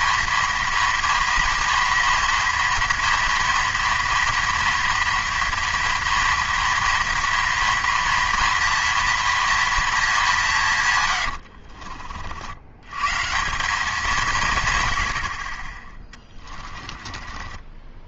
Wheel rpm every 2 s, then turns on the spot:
230, 230, 230, 230, 230, 150, 90, 140, 20.
16-18